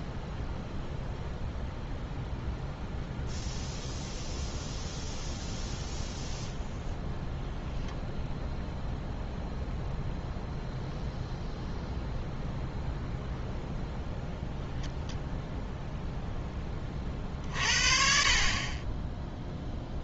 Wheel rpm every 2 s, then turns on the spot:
0, 0, 0, 0, 0, 0, 0, 0, 30, 20.
18-20